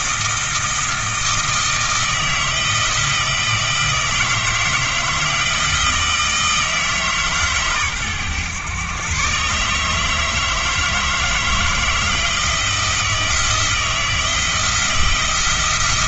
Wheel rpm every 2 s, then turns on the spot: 160, 160, 160, 160, 120, 160, 170, 160.
none